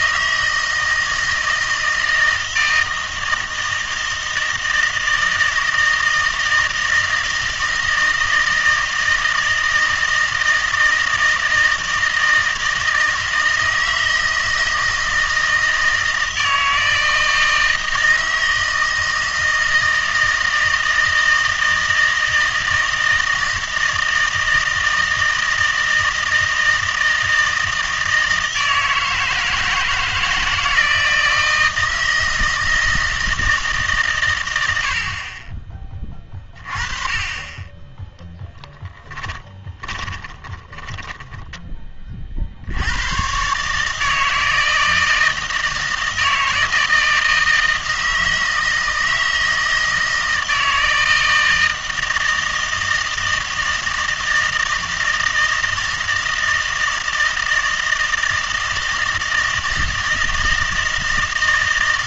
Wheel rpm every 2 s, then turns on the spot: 160, 160, 160, 160, 160, 160, 160, 160, 160, 160, 160, 160, 160, 160, 160, 160, 160, 80, 30, 10, 10, 90, 160, 160, 160, 160, 160, 160, 160, 160, 160.
38-42